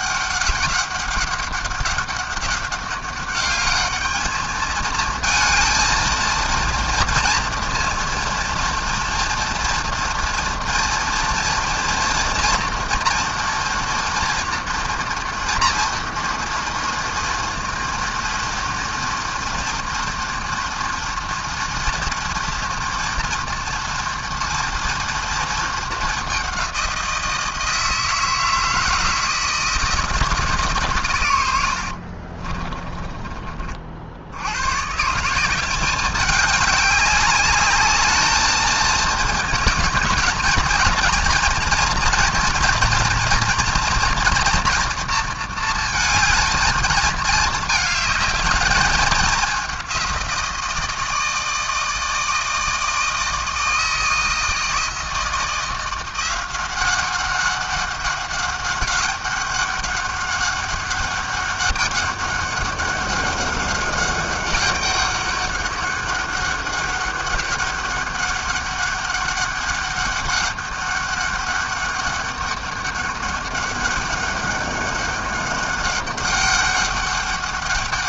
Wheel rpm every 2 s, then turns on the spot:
200, 200, 220, 230, 240, 230, 230, 240, 230, 230, 230, 230, 230, 190, 160, 140, 20, 130, 200, 220, 230, 240, 230, 220, 210, 160, 160, 160, 190, 200, 200, 200, 200, 200, 200, 200, 200, 200, 200.
32-34